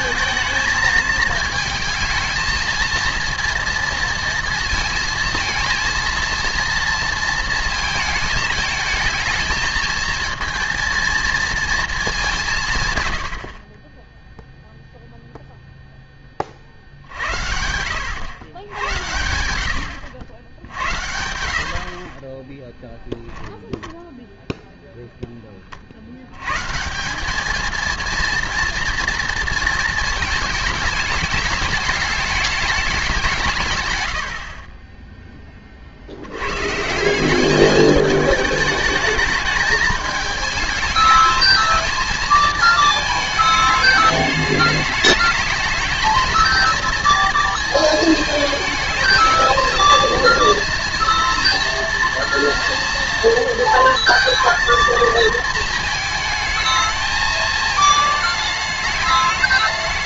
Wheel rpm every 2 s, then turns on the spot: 220, 230, 220, 230, 220, 230, 150, 0, 50, 100, 70, 10, 0, 140, 230, 220, 210, 30, 140, 210, 210, 220, 210, 230, 220, 230, 230, 230, 220, 210.
22-24